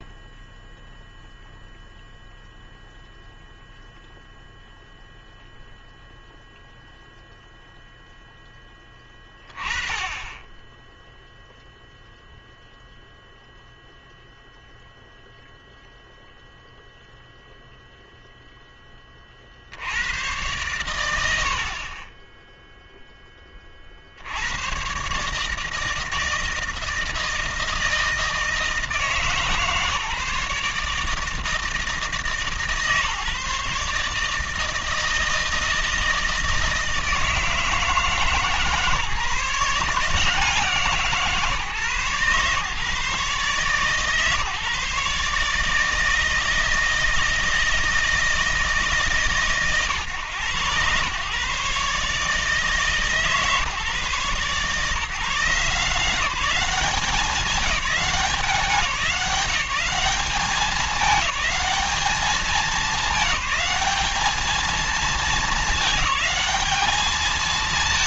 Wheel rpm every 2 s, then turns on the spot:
0, 0, 0, 0, 10, 10, 0, 0, 0, 10, 100, 0, 130, 160, 160, 150, 150, 160, 160, 150, 150, 130, 140, 160, 150, 120, 150, 140, 200, 190, 210, 200, 220, 210.
none